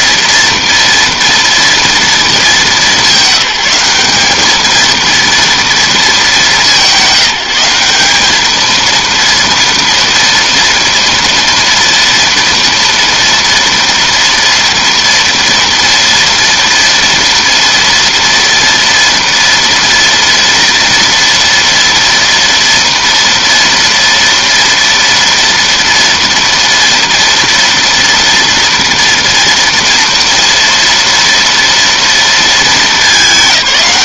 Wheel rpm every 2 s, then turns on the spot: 230, 190, 230, 180, 230, 230, 230, 240, 230, 230, 230, 230, 230, 230, 230, 240, 210.
none